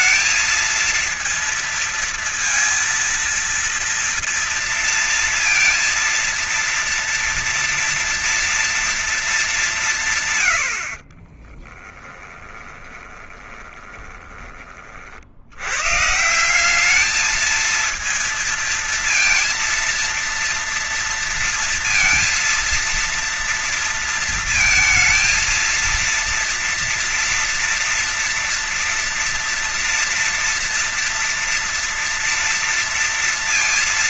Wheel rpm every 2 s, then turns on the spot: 220, 230, 230, 230, 230, 140, 20, 30, 160, 230, 230, 230, 230, 230, 230, 230, 230.
10-14